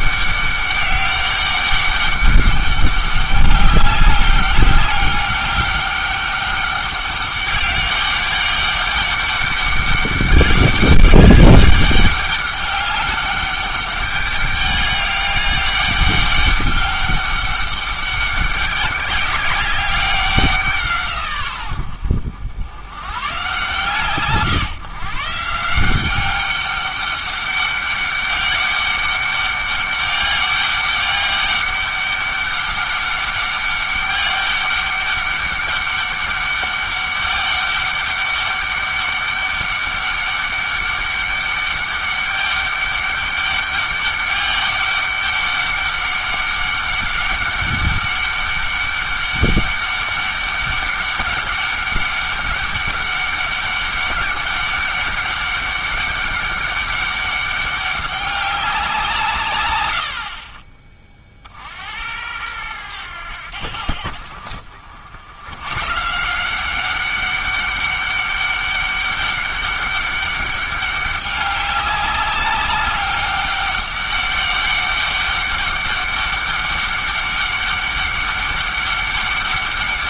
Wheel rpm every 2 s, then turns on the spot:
200, 200, 200, 200, 200, 200, 200, 200, 200, 200, 180, 80, 140, 200, 200, 200, 200, 200, 200, 200, 200, 200, 200, 200, 200, 200, 200, 200, 200, 190, 40, 100, 60, 180, 200, 200, 200, 200, 200, 200.
none